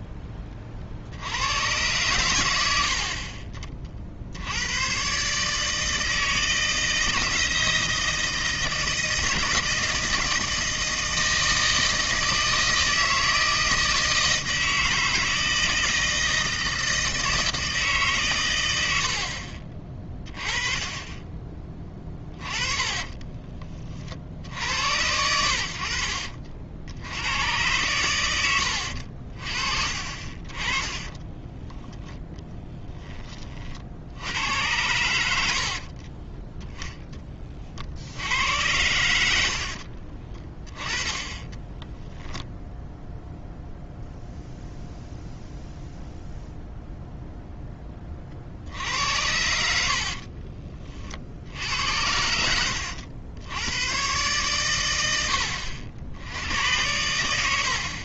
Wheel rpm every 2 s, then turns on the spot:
30, 80, 100, 160, 160, 160, 160, 160, 160, 100, 20, 20, 70, 60, 80, 30, 30, 90, 10, 90, 20, 0, 0, 0, 60, 40, 80, 110, 100.
22-24 30-34 50-54